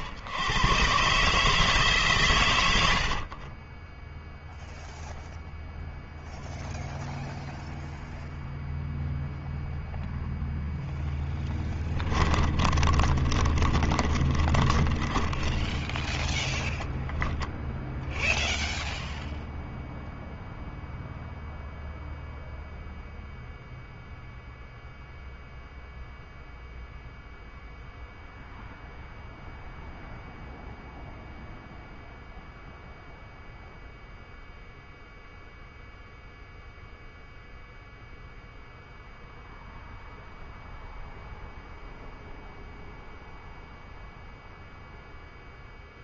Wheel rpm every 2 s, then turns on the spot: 130, 60, 0, 0, 0, 0, 30, 30, 0, 0, 0, 0, 0, 0, 0, 0, 0, 0, 0, 0, 0, 0, 0.
2-4 12-16